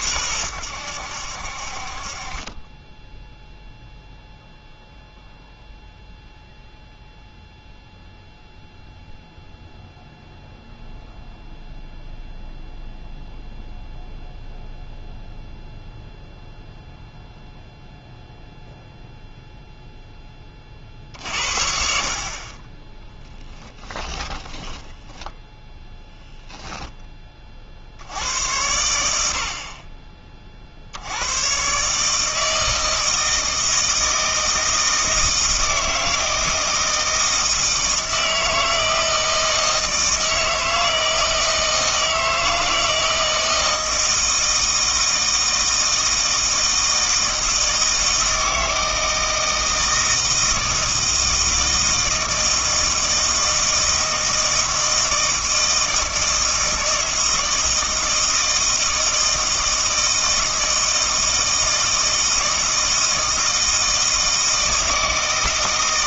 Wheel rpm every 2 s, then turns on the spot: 100, 10, 0, 0, 0, 0, 0, 0, 0, 0, 40, 20, 20, 10, 80, 60, 160, 160, 160, 160, 160, 160, 160, 160, 160, 160, 160, 160, 160, 160, 160, 160, 160.
24-26